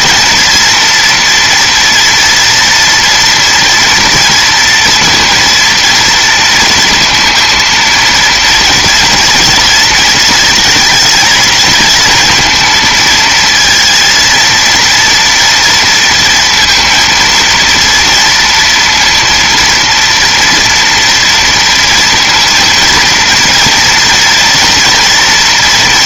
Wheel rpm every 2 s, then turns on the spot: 230, 230, 230, 230, 230, 220, 230, 230, 230, 230, 240, 230, 230.
none